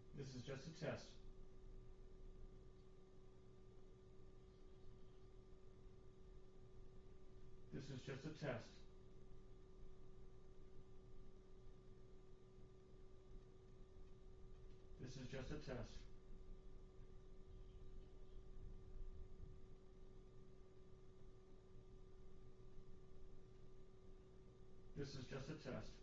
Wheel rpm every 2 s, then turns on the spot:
0, 0, 0, 0, 0, 0, 0, 0, 0, 0, 0, 0, 0.
none